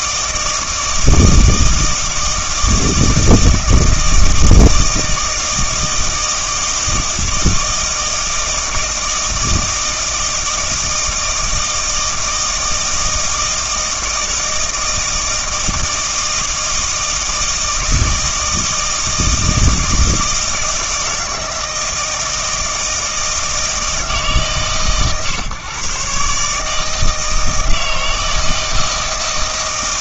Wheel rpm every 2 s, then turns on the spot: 160, 160, 160, 160, 160, 160, 160, 160, 160, 160, 160, 160, 130, 150, 160.
none